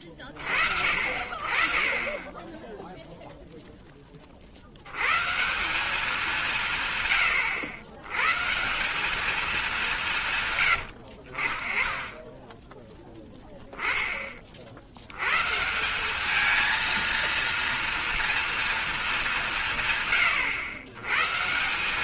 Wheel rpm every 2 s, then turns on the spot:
50, 0, 150, 100, 200, 60, 10, 80, 230, 230, 130.
none